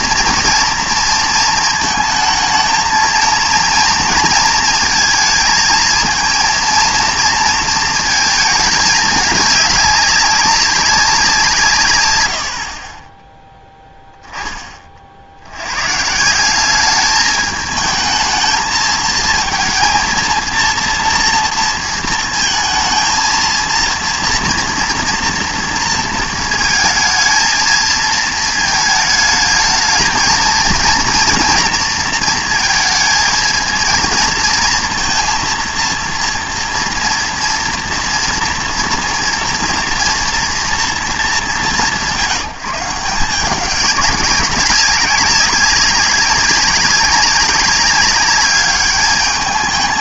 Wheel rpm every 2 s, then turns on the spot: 230, 220, 230, 230, 220, 200, 50, 30, 200, 220, 230, 230, 230, 230, 220, 230, 230, 230, 230, 240, 230, 180, 190, 190, 200.
none